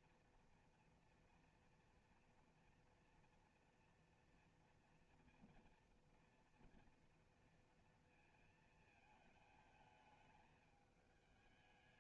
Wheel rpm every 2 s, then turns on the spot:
230, 230, 230, 240, 220, 220.
none